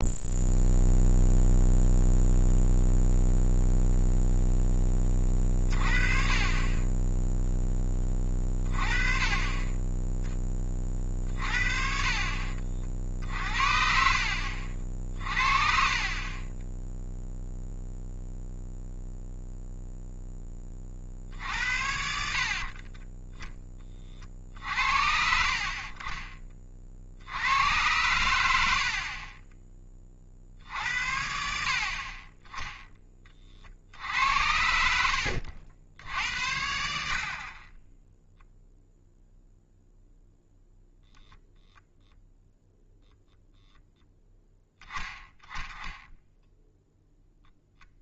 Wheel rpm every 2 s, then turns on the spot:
0, 0, 10, 20, 20, 30, 60, 50, 10, 0, 40, 30, 60, 40, 70, 60, 10, 70, 70, 0, 0, 0, 10, 0.
22-24